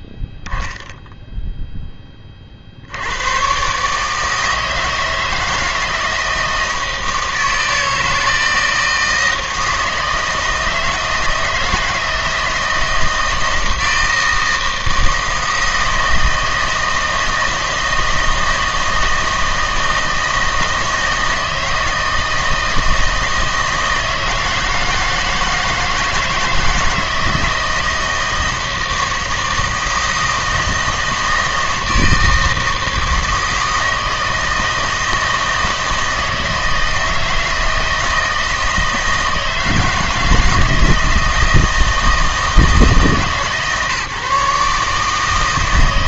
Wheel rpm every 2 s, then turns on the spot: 0, 60, 160, 160, 160, 160, 160, 160, 160, 160, 160, 160, 160, 170, 160, 160, 160, 160, 160, 160, 160, 160, 150.
none